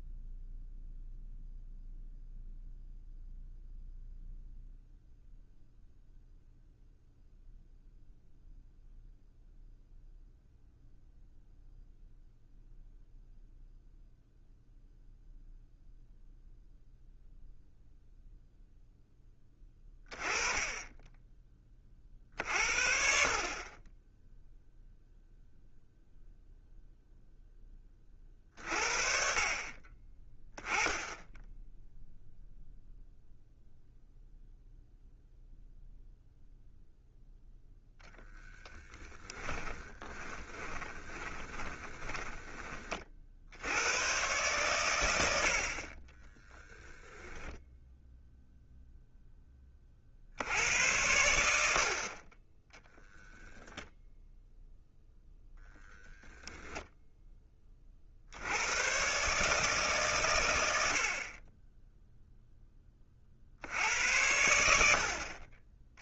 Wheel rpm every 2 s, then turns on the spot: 0, 0, 0, 0, 0, 0, 0, 0, 0, 0, 10, 50, 0, 0, 40, 20, 0, 0, 0, 10, 20, 30, 110, 0, 0, 80, 10, 0, 0, 100, 80, 20, 70.
38-42